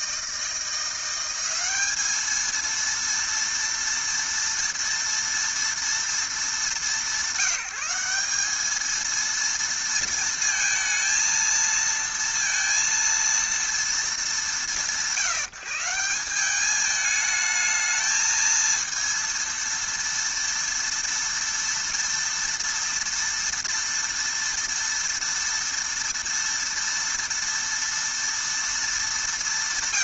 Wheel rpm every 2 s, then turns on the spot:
170, 230, 230, 190, 220, 230, 230, 190, 210, 230, 230, 230, 230, 230, 230.
none